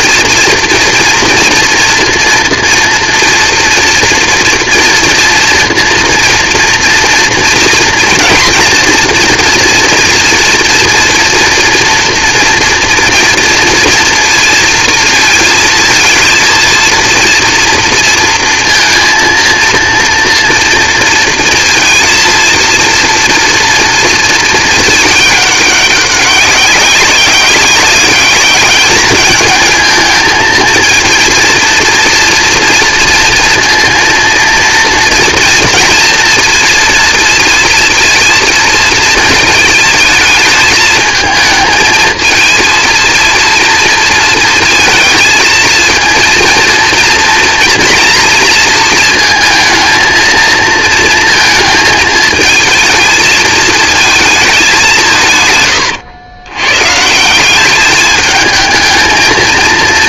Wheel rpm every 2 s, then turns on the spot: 230, 230, 230, 230, 230, 230, 230, 230, 230, 230, 230, 230, 220, 190, 200, 220, 230, 230, 230, 230, 220, 230, 230, 230, 230, 230, 220, 180, 130, 220.
none